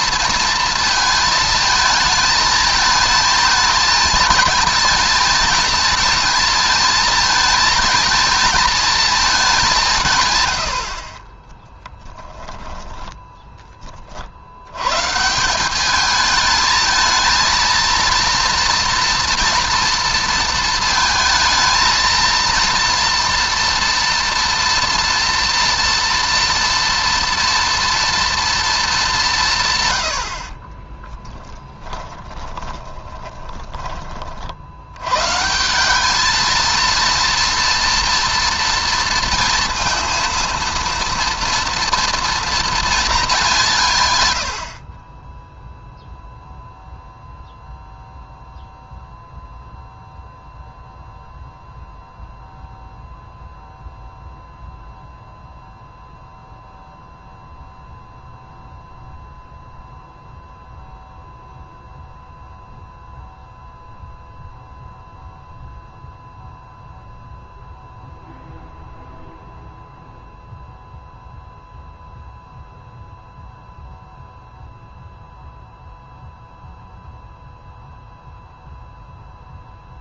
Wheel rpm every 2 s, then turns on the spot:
230, 220, 220, 220, 230, 80, 10, 100, 220, 230, 230, 230, 230, 230, 220, 20, 20, 70, 230, 230, 230, 230, 50, 0, 0, 0, 0, 0, 0, 0, 0, 0, 0, 0, 0, 0, 0, 0, 0, 0.
12-14 30-34